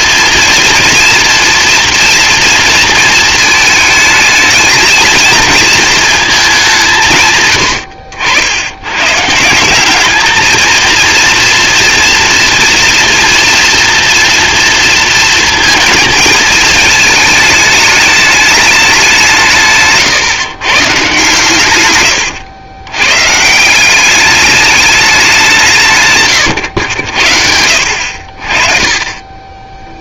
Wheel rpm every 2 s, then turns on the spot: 230, 230, 220, 190, 100, 220, 230, 230, 220, 200, 130, 110, 210, 110, 30.
none